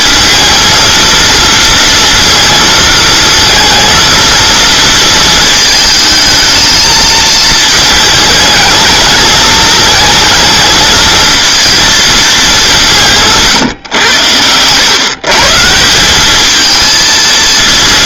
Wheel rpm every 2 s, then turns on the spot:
230, 230, 230, 220, 220, 220, 180, 120, 220.
none